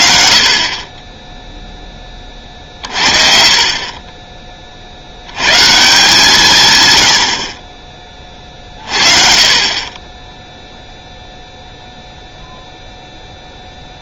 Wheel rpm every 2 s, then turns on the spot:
60, 40, 40, 130, 30, 0, 0.
none